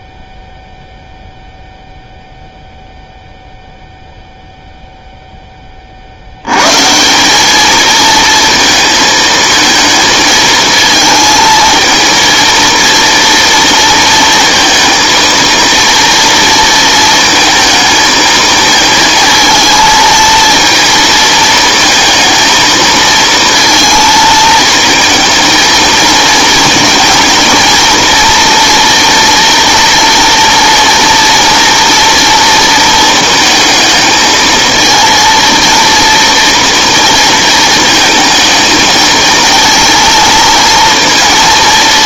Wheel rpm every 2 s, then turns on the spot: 0, 0, 0, 100, 220, 220, 230, 230, 230, 230, 230, 230, 220, 230, 230, 230, 230, 220, 230, 220, 230.
none